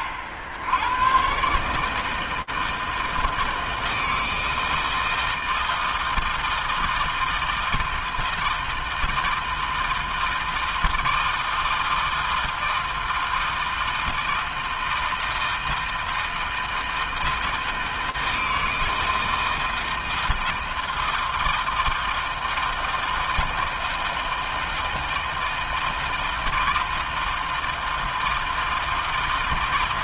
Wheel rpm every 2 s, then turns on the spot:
70, 160, 160, 160, 160, 160, 160, 160, 160, 160, 160, 160, 160, 160, 160.
none